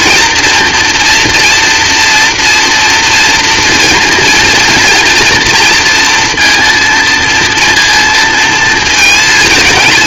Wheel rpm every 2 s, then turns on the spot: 240, 240, 240, 230, 230.
none